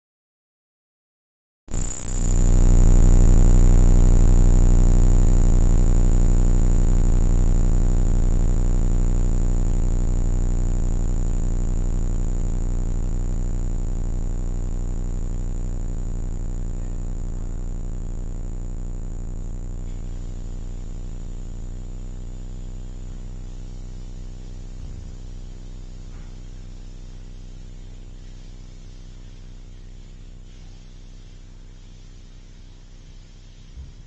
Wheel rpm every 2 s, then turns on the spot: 0, 0, 0, 0, 0, 0, 0, 0, 0, 0, 0, 0, 0, 0, 0, 0, 0.
none